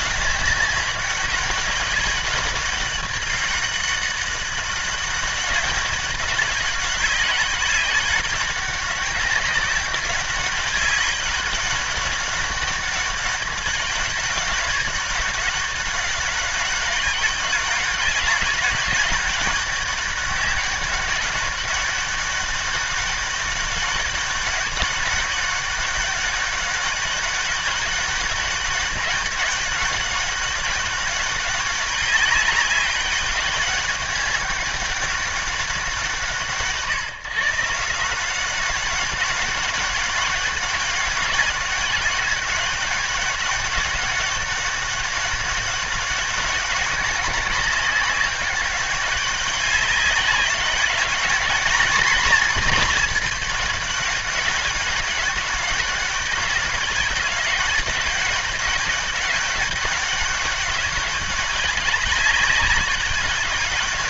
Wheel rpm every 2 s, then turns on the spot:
200, 200, 200, 190, 200, 200, 200, 190, 200, 200, 200, 200, 200, 200, 200, 200, 190, 200, 140, 180, 190, 200, 190, 200, 190, 190, 210, 190, 190, 200, 200, 200.
none